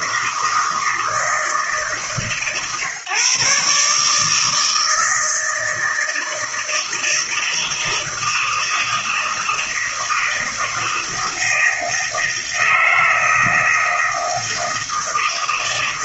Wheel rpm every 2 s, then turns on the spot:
160, 140, 160, 160, 160, 160, 160, 160.
none